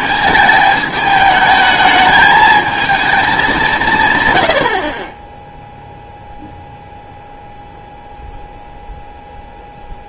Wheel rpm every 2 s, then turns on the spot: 220, 220, 40, 0, 0.
none